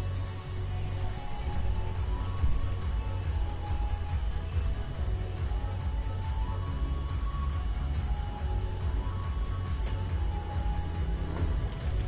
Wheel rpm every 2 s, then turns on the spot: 0, 0, 0, 0, 0, 0.
none